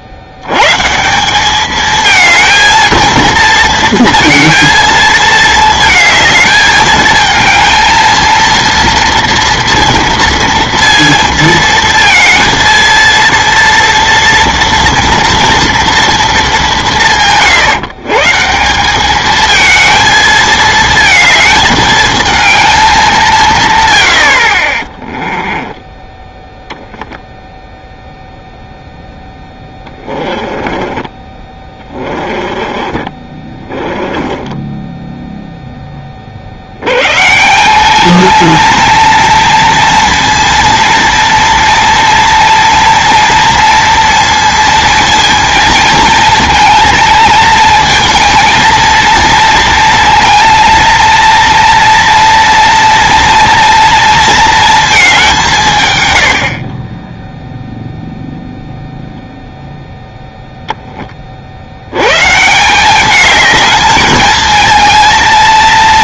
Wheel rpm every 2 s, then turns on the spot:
120, 220, 230, 220, 230, 230, 230, 230, 190, 180, 230, 220, 40, 0, 0, 20, 20, 10, 90, 230, 230, 230, 230, 230, 230, 230, 230, 230, 50, 0, 0, 170, 220.
30-36